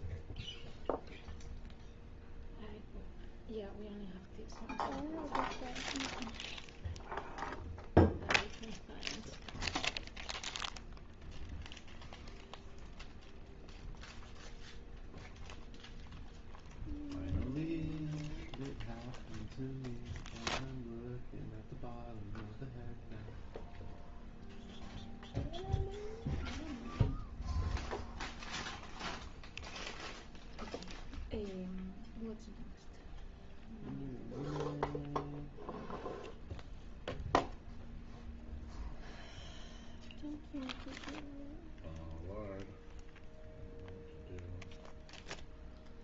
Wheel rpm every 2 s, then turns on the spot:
0, 0, 0, 0, 0, 0, 0, 0, 0, 0, 0, 0, 0, 0, 0, 0, 0, 0, 0, 0, 0, 0, 0.
none